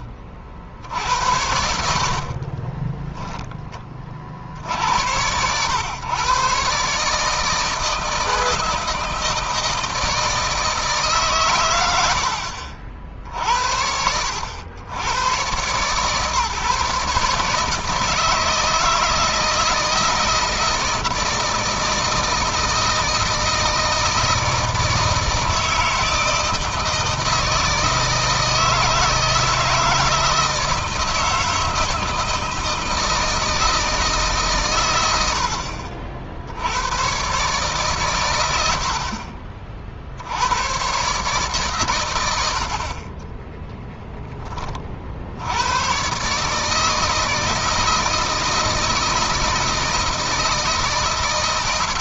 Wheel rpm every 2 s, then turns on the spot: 60, 30, 60, 140, 160, 160, 60, 90, 140, 160, 160, 160, 160, 160, 160, 160, 160, 120, 90, 90, 100, 100, 30, 150, 160, 160.
2-4